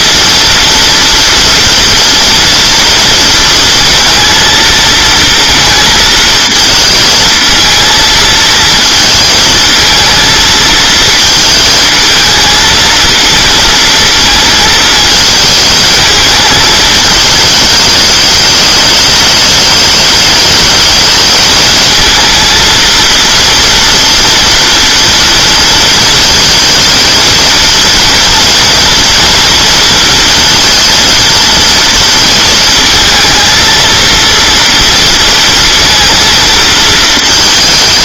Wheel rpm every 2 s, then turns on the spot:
230, 230, 230, 220, 230, 220, 230, 220, 220, 210, 220, 230, 230, 230, 230, 230, 220, 230, 220.
none